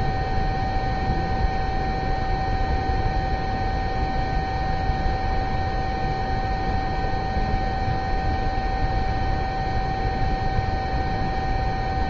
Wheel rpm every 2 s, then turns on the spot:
0, 0, 0, 0, 0, 0.
none